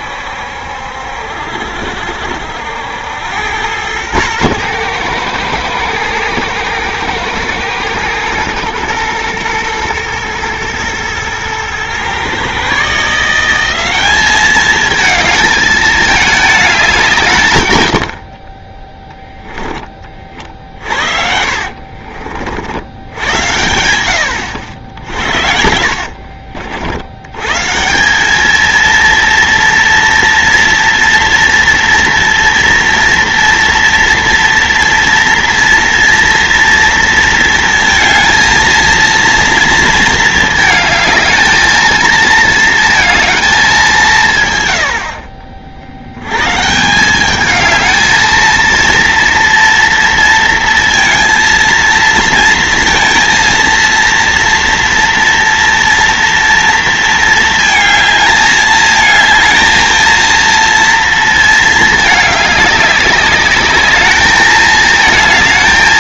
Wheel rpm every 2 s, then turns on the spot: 70, 70, 110, 110, 110, 110, 130, 210, 200, 40, 50, 70, 80, 50, 200, 230, 240, 230, 230, 230, 220, 230, 120, 130, 220, 230, 230, 230, 230, 220, 230, 210, 220.
20-22